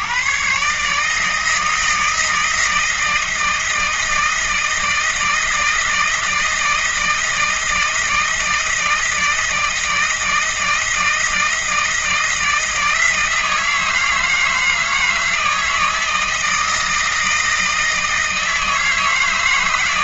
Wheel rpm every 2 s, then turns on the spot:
150, 160, 160, 160, 160, 160, 160, 160, 160, 160.
none